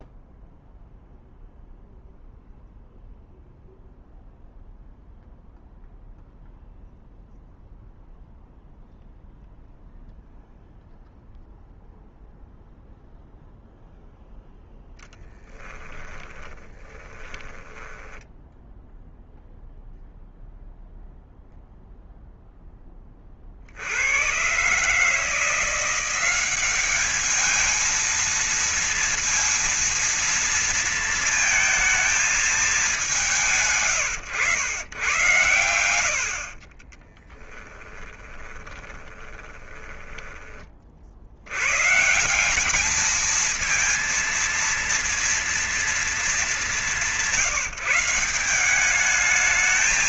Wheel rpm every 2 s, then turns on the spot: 0, 0, 0, 0, 0, 0, 0, 0, 20, 10, 0, 0, 110, 180, 230, 230, 220, 110, 60, 20, 20, 170, 230, 220, 180.
16-20 36-40